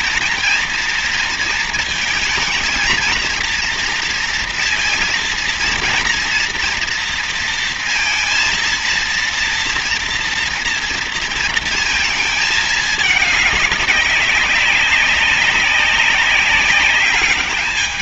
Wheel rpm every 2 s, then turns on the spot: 230, 230, 230, 230, 230, 230, 220, 190, 190.
none